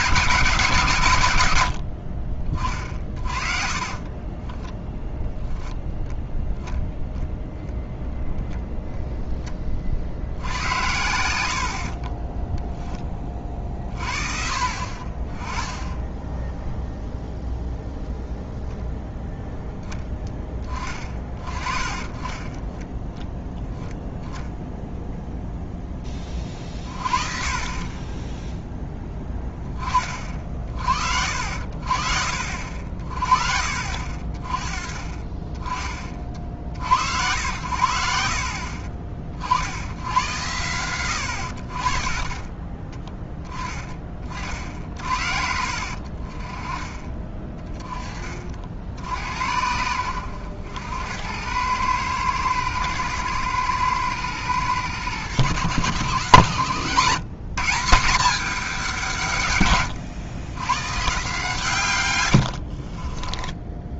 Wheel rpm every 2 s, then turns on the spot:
160, 30, 10, 0, 0, 80, 10, 50, 0, 0, 20, 10, 0, 40, 10, 50, 50, 30, 70, 50, 110, 20, 50, 30, 60, 90, 110, 110, 120, 190, 130, 60.
4-6 22-24 62-64